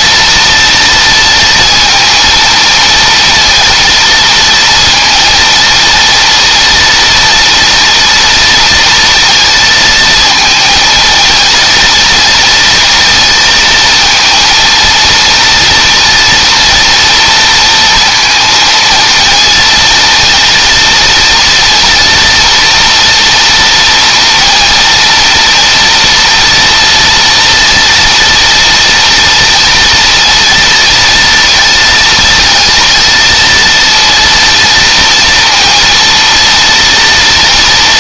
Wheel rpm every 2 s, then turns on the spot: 230, 230, 230, 230, 230, 220, 230, 230, 230, 230, 230, 230, 230, 230, 230, 230, 230, 230, 230.
none